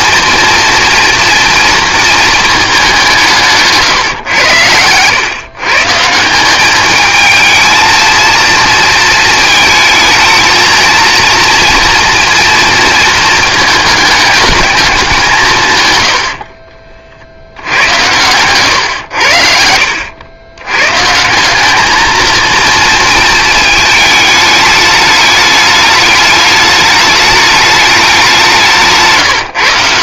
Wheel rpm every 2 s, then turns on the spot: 230, 190, 110, 210, 220, 220, 230, 210, 40, 110, 120, 230, 210, 210, 170.
none